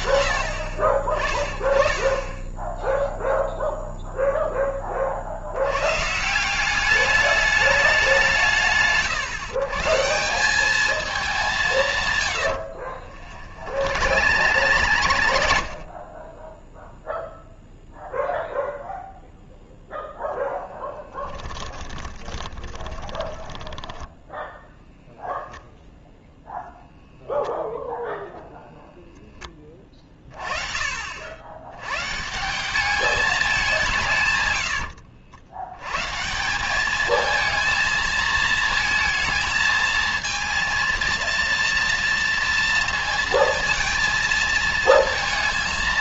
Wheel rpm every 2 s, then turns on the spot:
40, 0, 20, 200, 140, 210, 60, 100, 0, 0, 20, 20, 0, 0, 20, 120, 170, 110, 220, 230, 230, 230, 180.
12-16 20-24